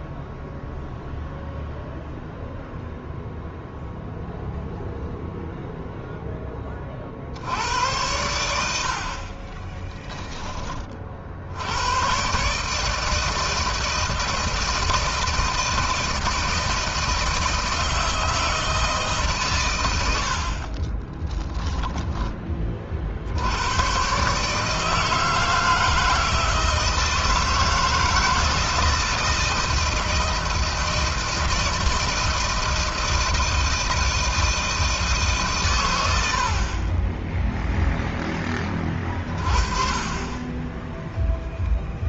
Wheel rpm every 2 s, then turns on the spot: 0, 0, 0, 30, 80, 30, 140, 160, 160, 160, 40, 30, 150, 160, 160, 160, 160, 160, 50, 30, 10.
20-22